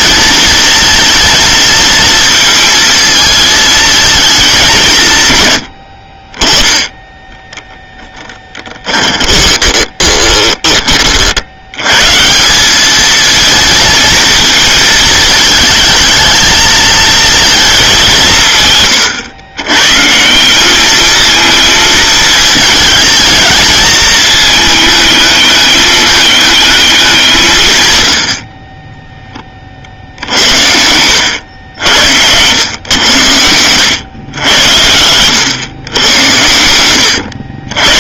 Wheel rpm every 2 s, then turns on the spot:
230, 230, 190, 10, 10, 20, 190, 220, 220, 150, 190, 220, 220, 210, 40, 70, 100, 100, 110.
8-10 30-32 36-38